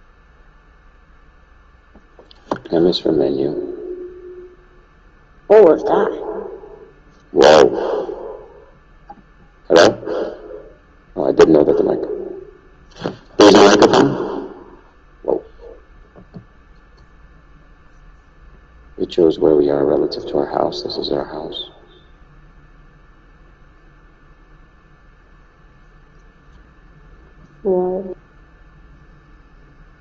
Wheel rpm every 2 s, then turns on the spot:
0, 0, 0, 0, 0, 0, 0, 0, 0, 0, 0, 0, 0, 0, 0.
none